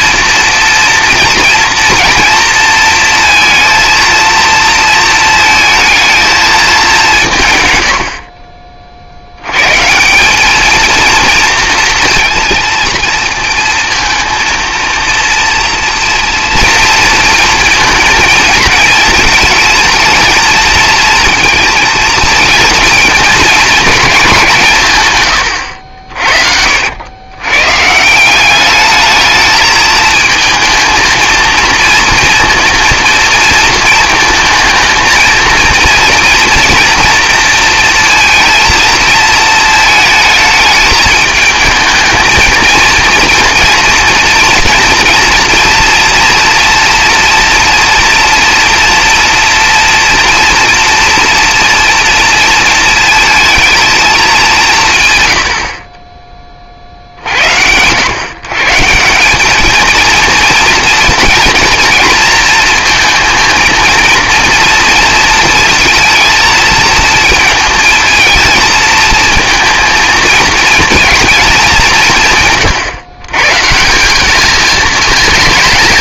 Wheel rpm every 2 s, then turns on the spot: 230, 230, 230, 210, 40, 220, 240, 230, 230, 230, 220, 220, 150, 70, 200, 220, 230, 220, 230, 230, 220, 230, 230, 230, 230, 230, 220, 160, 40, 150, 230, 230, 230, 230, 220, 230, 140, 220.
none